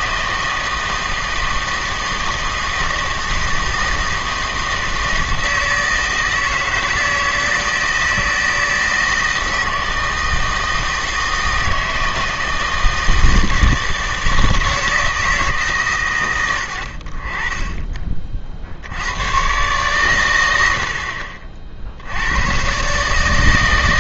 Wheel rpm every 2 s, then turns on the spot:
160, 160, 160, 160, 160, 160, 160, 160, 90, 50, 80, 120.
none